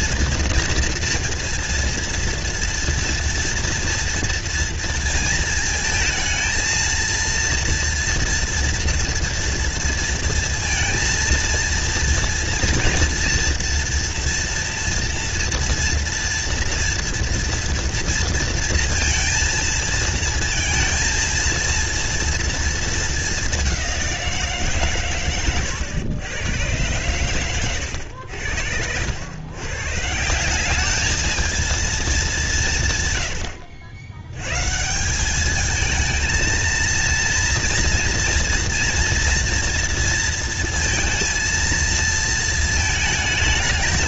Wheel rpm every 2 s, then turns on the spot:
240, 230, 230, 230, 230, 230, 230, 230, 230, 230, 230, 230, 120, 110, 80, 190, 170, 150, 230, 240, 230, 220.
none